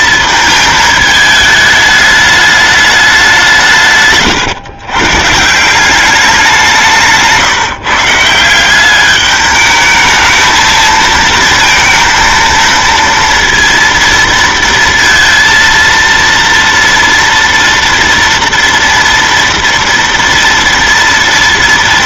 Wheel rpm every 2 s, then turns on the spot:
220, 210, 120, 190, 180, 220, 230, 230, 230, 230, 230.
none